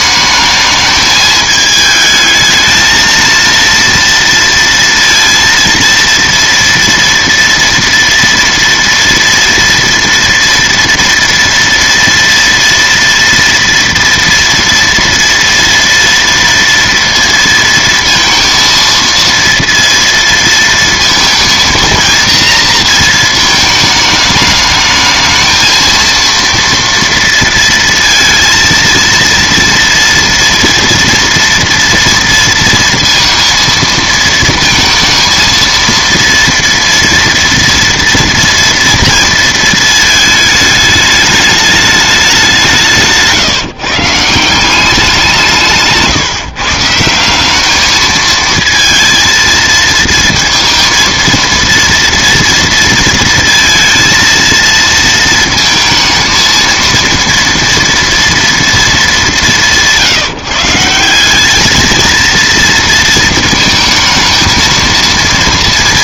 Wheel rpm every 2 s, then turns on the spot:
220, 220, 230, 230, 230, 230, 230, 230, 230, 230, 230, 230, 220, 230, 230, 240, 230, 230, 230, 230, 220, 190, 190, 150, 220, 230, 230, 230, 230, 230, 170, 230, 230.
none